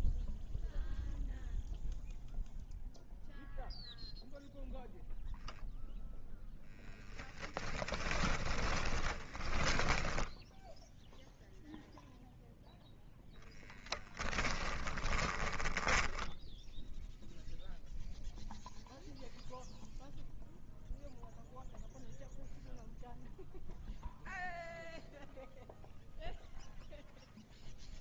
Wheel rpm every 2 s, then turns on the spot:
0, 0, 0, 0, 20, 0, 0, 10, 0, 0, 0, 0, 0, 0.
8-10 14-16